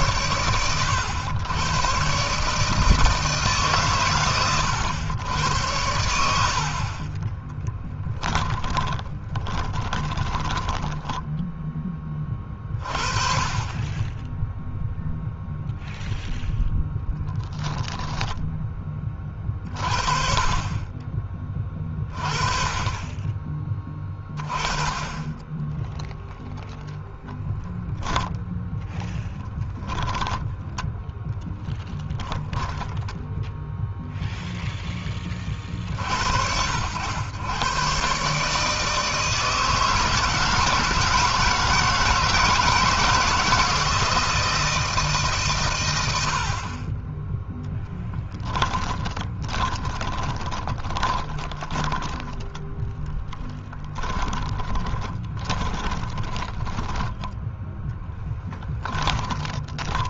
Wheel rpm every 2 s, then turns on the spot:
110, 160, 110, 50, 20, 10, 40, 0, 0, 20, 20, 30, 30, 0, 10, 10, 10, 10, 90, 150, 160, 160, 160, 30, 20, 30, 10, 20, 10, 20.
6-12 32-34 48-52 54-60